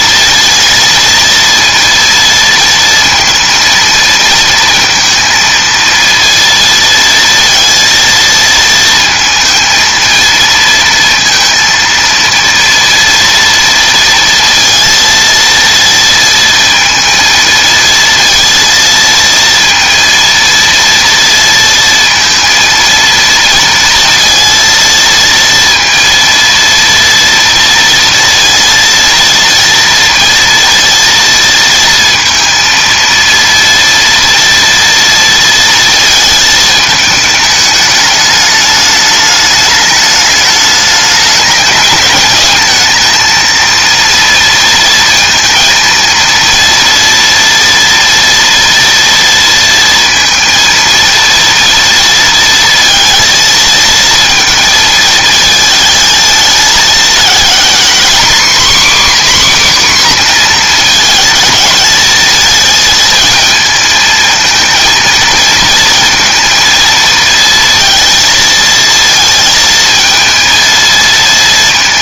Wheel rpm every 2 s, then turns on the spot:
230, 230, 230, 230, 230, 230, 230, 230, 230, 230, 230, 230, 230, 230, 230, 230, 230, 230, 220, 210, 210, 210, 230, 230, 230, 230, 230, 230, 220, 270, 240, 220, 220, 230, 230, 230.
none